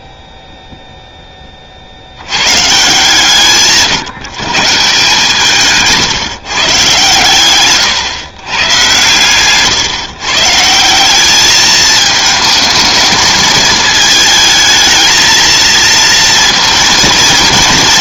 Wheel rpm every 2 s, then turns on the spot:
0, 140, 160, 150, 130, 160, 220, 220, 230.
none